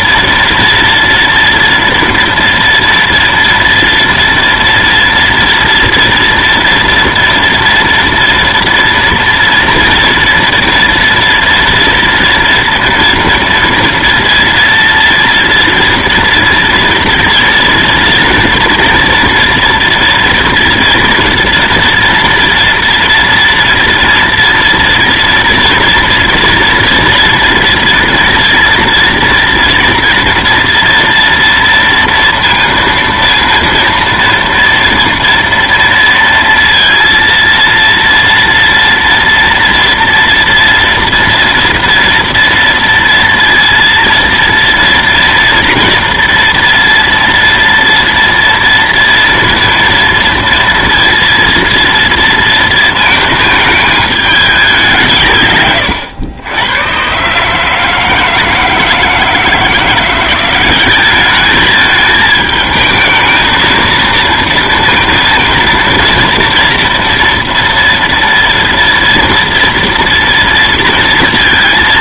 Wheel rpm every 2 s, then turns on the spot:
230, 230, 230, 230, 230, 230, 230, 230, 230, 230, 230, 240, 230, 230, 230, 230, 230, 230, 230, 230, 240, 230, 230, 240, 230, 230, 230, 200, 100, 160, 190, 220, 230, 230, 230, 230.
none